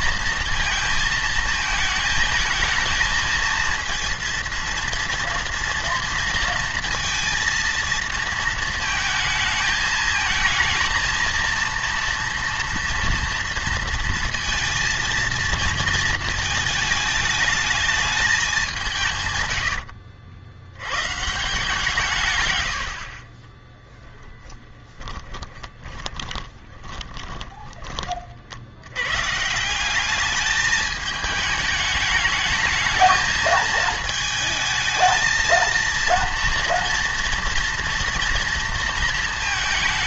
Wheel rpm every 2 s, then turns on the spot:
230, 220, 230, 230, 220, 220, 230, 230, 220, 190, 80, 100, 30, 10, 80, 210, 220, 220, 230, 230.
24-28